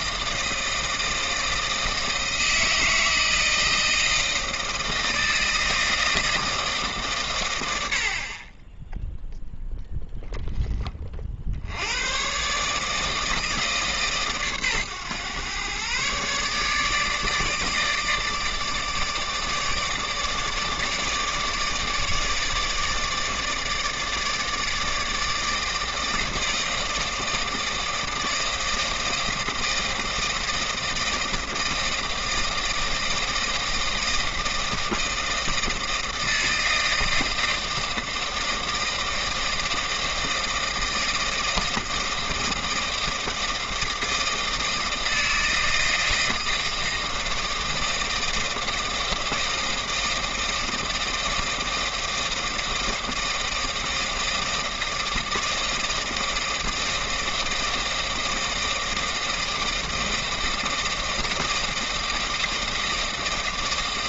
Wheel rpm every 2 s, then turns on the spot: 160, 160, 160, 150, 10, 20, 150, 130, 150, 150, 150, 160, 160, 160, 160, 160, 160, 160, 160, 160, 160, 160, 160, 160, 160, 160, 160, 160, 160, 160, 160, 160.
none